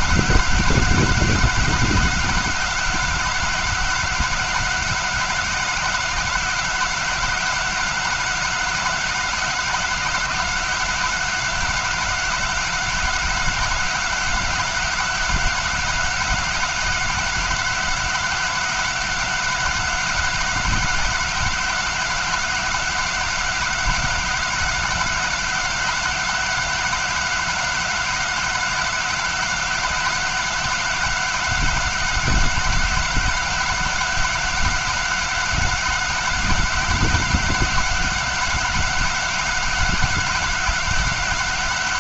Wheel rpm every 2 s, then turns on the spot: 190, 190, 190, 190, 190, 190, 190, 190, 190, 190, 190, 190, 190, 190, 190, 190, 190, 190, 190, 190, 190.
none